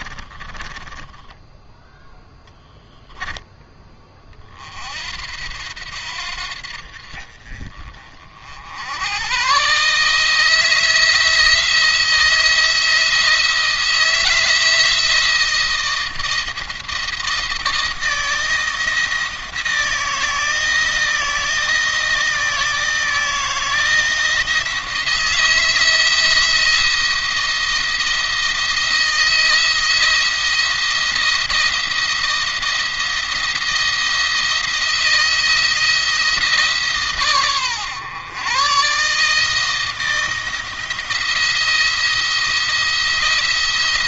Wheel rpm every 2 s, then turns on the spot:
20, 10, 40, 60, 70, 160, 160, 170, 160, 160, 160, 160, 170, 170, 170, 170, 170, 170, 160, 130, 170, 170.
0-2